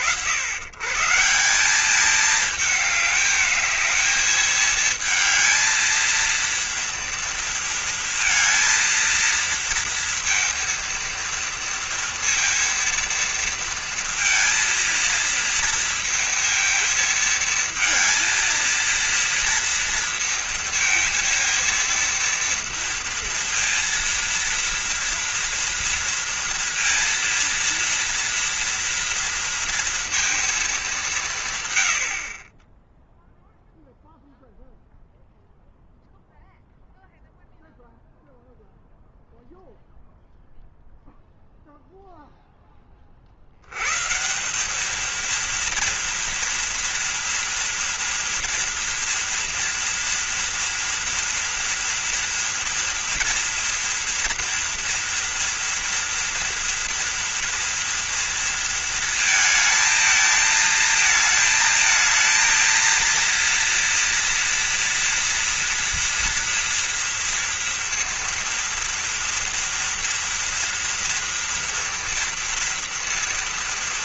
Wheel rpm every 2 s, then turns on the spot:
100, 210, 220, 230, 230, 230, 230, 230, 230, 230, 230, 230, 230, 230, 230, 200, 20, 0, 0, 0, 0, 20, 210, 230, 240, 230, 230, 230, 230, 220, 220, 230, 230, 230, 230, 230, 230.
none